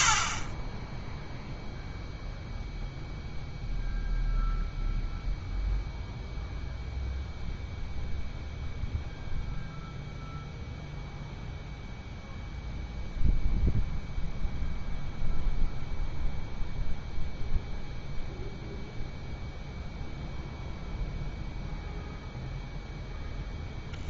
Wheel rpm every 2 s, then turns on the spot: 20, 0, 0, 0, 0, 0, 0, 0, 0, 0, 0, 0.
none